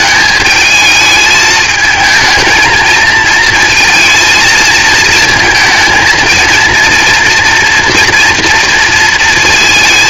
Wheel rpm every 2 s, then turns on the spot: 220, 220, 220, 230, 230.
none